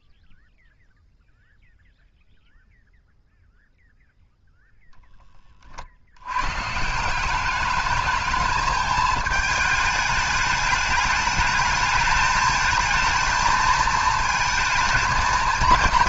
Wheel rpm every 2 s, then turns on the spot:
0, 0, 0, 150, 220, 210, 220, 230.
none